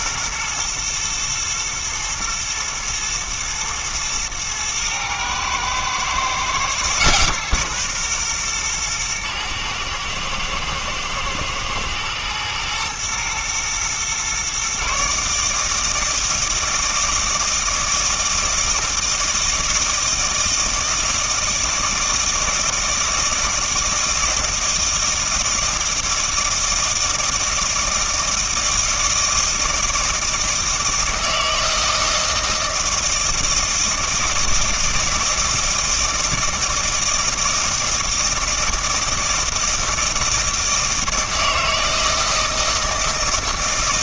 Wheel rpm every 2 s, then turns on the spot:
120, 110, 110, 130, 120, 110, 120, 130, 160, 160, 160, 160, 160, 160, 160, 160, 160, 160, 160, 160, 160, 160.
none